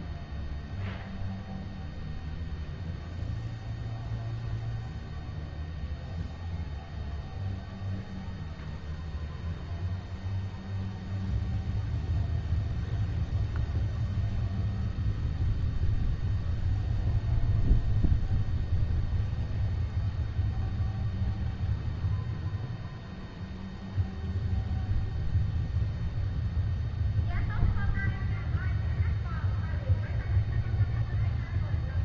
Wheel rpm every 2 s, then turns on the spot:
0, 0, 0, 0, 0, 0, 0, 0, 0, 0, 0, 0, 0, 0, 0, 0.
none